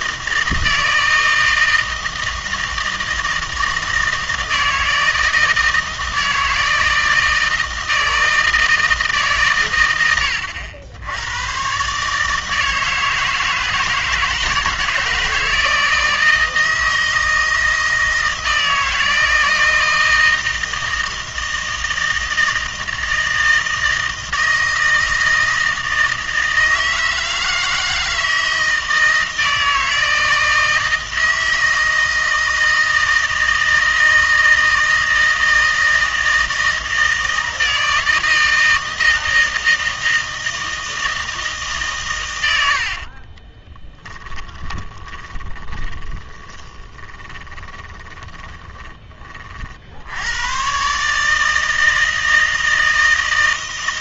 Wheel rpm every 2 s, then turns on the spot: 160, 160, 160, 160, 160, 80, 150, 160, 160, 160, 160, 160, 160, 160, 160, 160, 160, 160, 160, 160, 160, 70, 20, 30, 30, 120, 160.
42-50